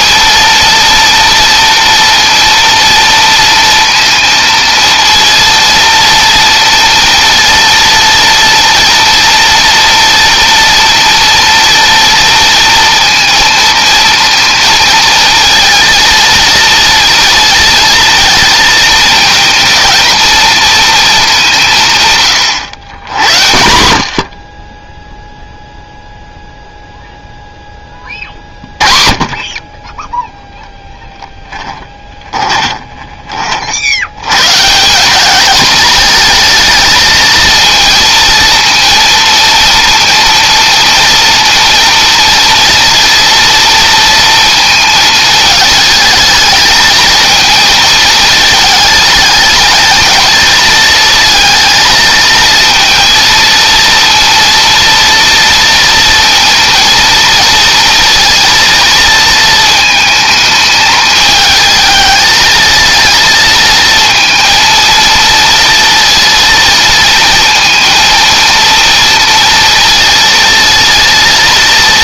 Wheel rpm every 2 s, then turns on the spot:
230, 230, 230, 230, 230, 230, 230, 230, 230, 220, 220, 90, 0, 0, 40, 0, 30, 190, 230, 230, 230, 230, 220, 220, 220, 220, 230, 230, 230, 220, 220, 230, 230, 230, 230, 230.
none